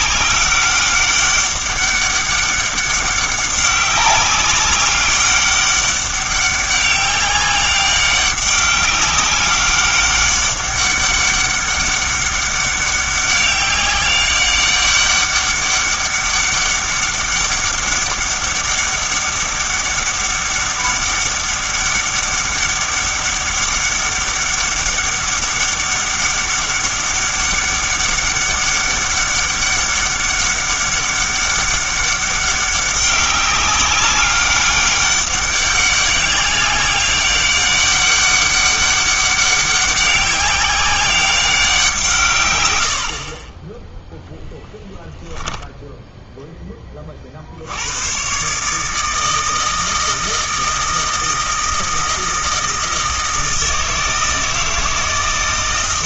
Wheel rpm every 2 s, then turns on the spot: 200, 200, 200, 200, 200, 200, 200, 200, 200, 200, 200, 200, 200, 200, 200, 200, 190, 200, 200, 200, 190, 90, 0, 10, 150, 160, 160, 160.
none